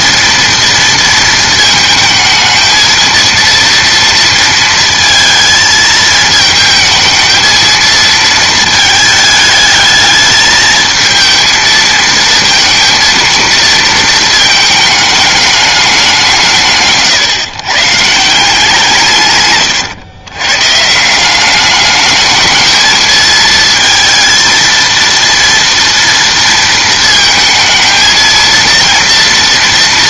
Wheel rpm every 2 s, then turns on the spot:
230, 220, 230, 220, 220, 220, 220, 220, 160, 170, 140, 220, 230, 230, 230.
none